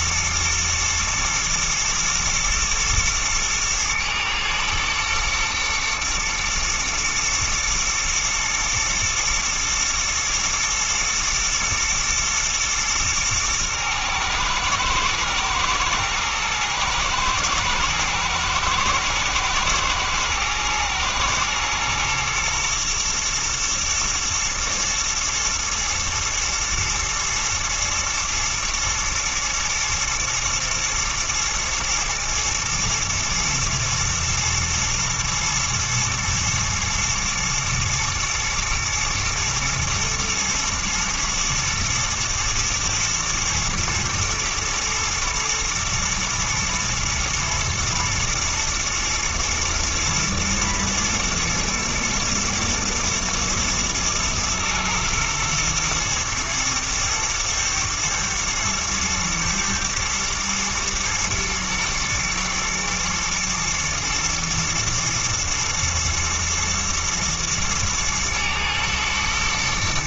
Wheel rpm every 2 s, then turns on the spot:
110, 120, 110, 110, 120, 110, 110, 110, 110, 110, 120, 120, 110, 110, 110, 120, 110, 110, 110, 110, 110, 110, 110, 120, 120, 110, 110, 120, 110, 110, 110, 120, 120, 110, 110.
none